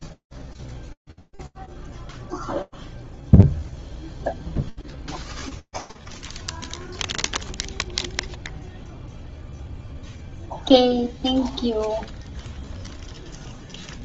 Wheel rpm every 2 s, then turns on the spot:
0, 0, 0, 0, 0, 0, 0.
none